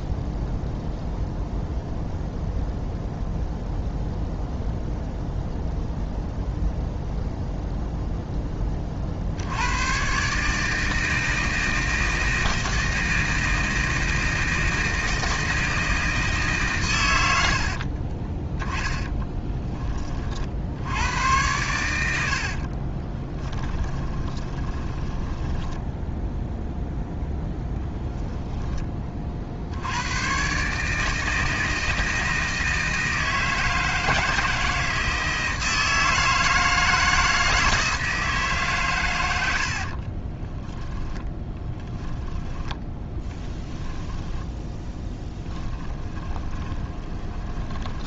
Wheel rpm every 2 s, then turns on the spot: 0, 0, 0, 0, 30, 160, 160, 160, 130, 20, 70, 30, 10, 0, 20, 140, 160, 160, 160, 130, 30, 20, 10, 20.
18-20 22-26 40-48